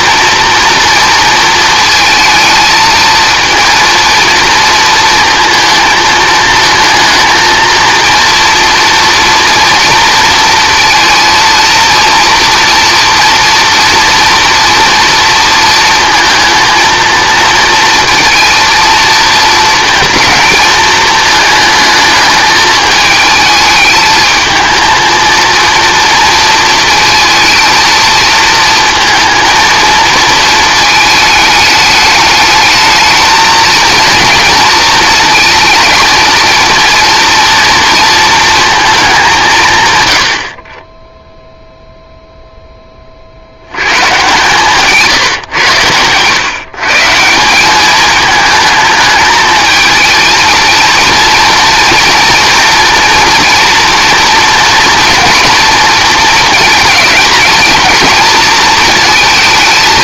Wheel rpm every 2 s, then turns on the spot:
230, 220, 230, 220, 230, 230, 230, 230, 230, 230, 230, 220, 220, 230, 220, 230, 210, 220, 230, 230, 110, 0, 140, 120, 220, 220, 230, 230, 230, 220.
none